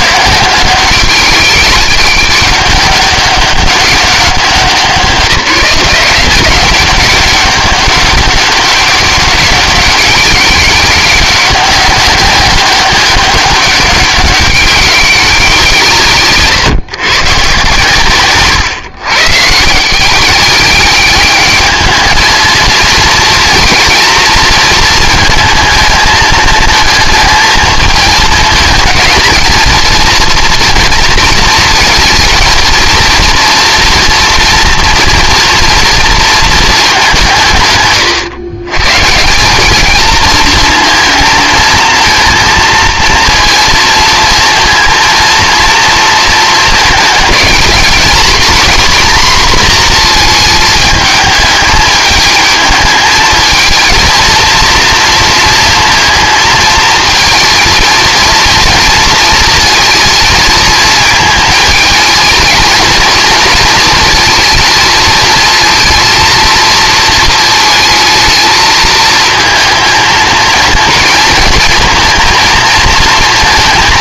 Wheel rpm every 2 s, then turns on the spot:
180, 200, 170, 190, 200, 200, 200, 190, 130, 130, 200, 230, 220, 220, 220, 240, 230, 230, 210, 140, 230, 230, 230, 220, 240, 220, 220, 230, 220, 230, 220, 230, 220, 230, 220, 220, 230.
none